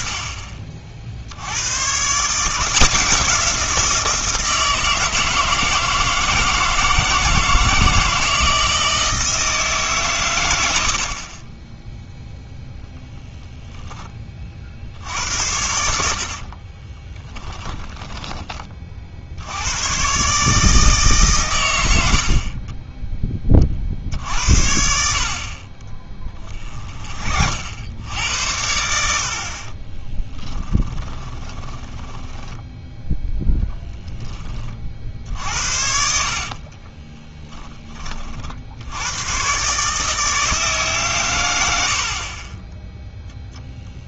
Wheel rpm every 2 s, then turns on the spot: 30, 170, 160, 160, 170, 100, 10, 60, 30, 30, 150, 40, 70, 30, 80, 10, 10, 30, 40, 60, 150, 20.
16-18 26-28 30-34 36-38